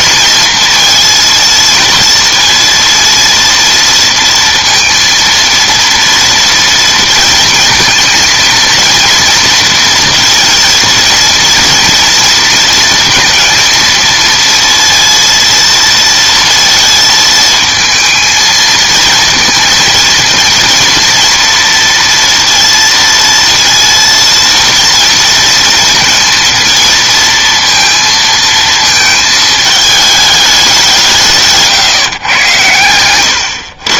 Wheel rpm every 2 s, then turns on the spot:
230, 230, 230, 230, 230, 230, 230, 230, 230, 230, 240, 230, 230, 230, 220, 170, 110.
none